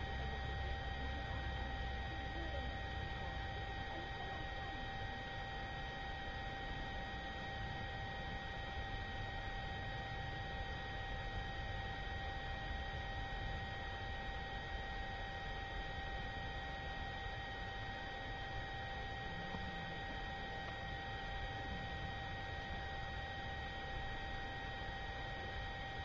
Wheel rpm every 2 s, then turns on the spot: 0, 0, 0, 0, 0, 0, 0, 0, 0, 0, 0, 0, 0.
none